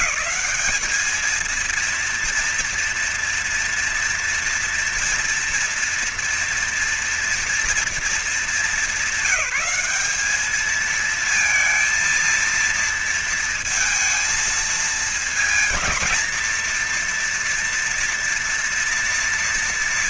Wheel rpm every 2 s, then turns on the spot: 220, 230, 230, 240, 200, 200, 230, 230, 230, 240.
none